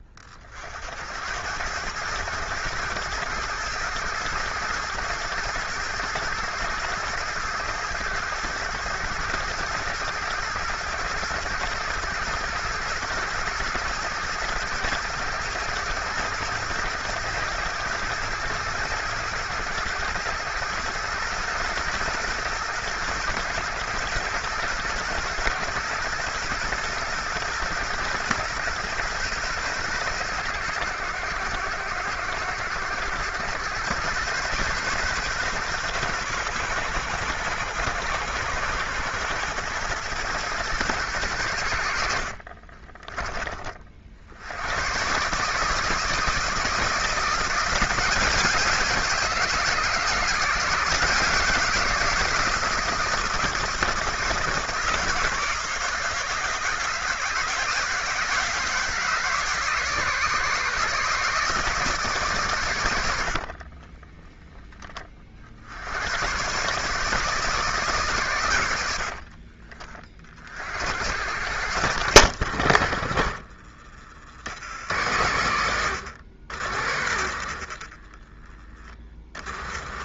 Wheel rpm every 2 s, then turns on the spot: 70, 110, 110, 110, 110, 120, 120, 110, 110, 120, 110, 120, 120, 120, 120, 100, 100, 130, 110, 110, 120, 50, 120, 170, 180, 170, 160, 160, 160, 150, 150, 100, 30, 140, 70, 70, 60, 100, 80, 40.
62-64